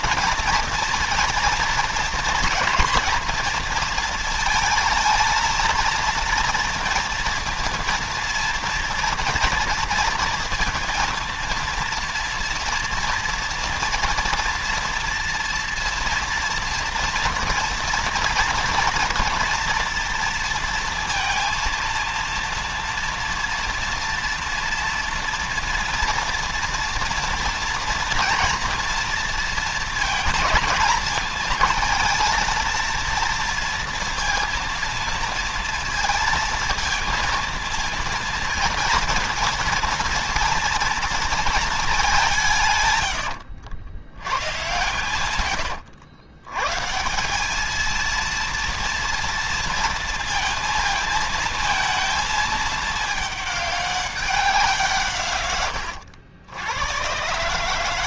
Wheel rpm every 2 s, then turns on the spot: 230, 230, 230, 230, 230, 230, 230, 230, 230, 230, 230, 230, 230, 230, 230, 220, 220, 230, 230, 230, 230, 160, 120, 130, 230, 230, 220, 180, 90.
none